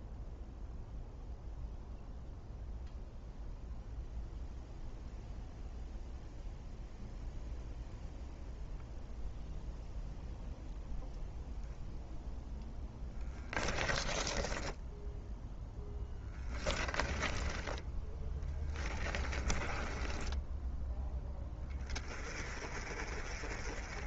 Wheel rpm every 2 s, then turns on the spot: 0, 0, 0, 0, 0, 0, 0, 0, 20, 10, 10, 30.
16-20